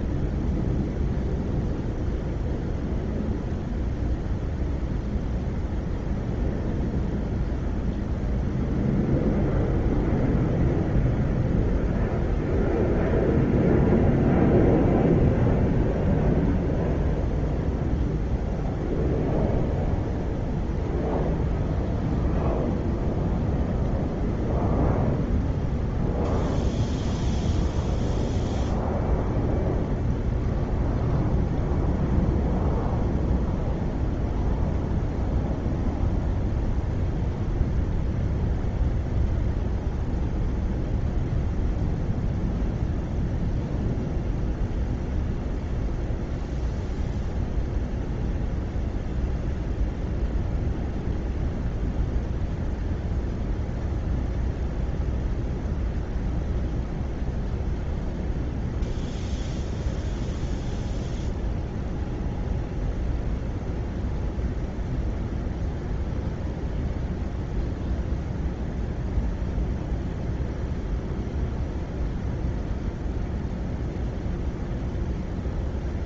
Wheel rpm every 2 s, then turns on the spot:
0, 0, 0, 0, 0, 0, 0, 0, 0, 0, 0, 0, 0, 0, 0, 0, 0, 0, 0, 0, 0, 0, 0, 0, 0, 0, 0, 0, 0, 0, 0, 0, 0, 0, 0, 0, 0, 0.
none